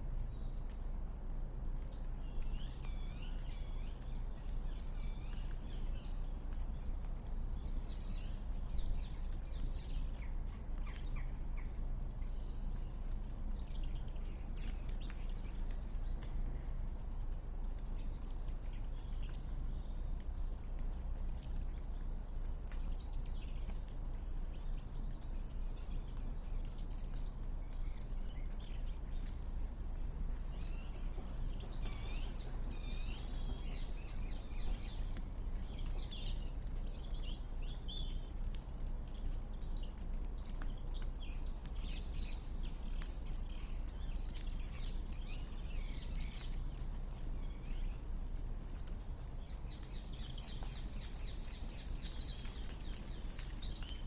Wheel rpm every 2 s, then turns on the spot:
0, 0, 0, 0, 0, 0, 0, 0, 0, 0, 0, 0, 0, 0, 0, 0, 0, 0, 0, 0, 0, 0, 0, 0, 0, 0, 0.
none